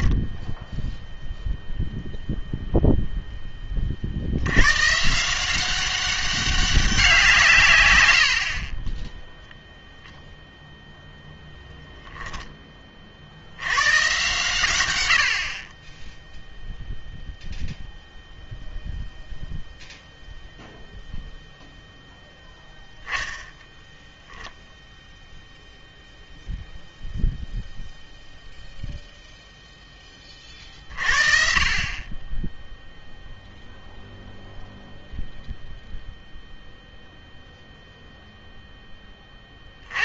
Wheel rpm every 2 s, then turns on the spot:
0, 0, 110, 190, 40, 0, 20, 120, 0, 0, 0, 0, 0, 0, 0, 40, 0, 0, 0, 10.
none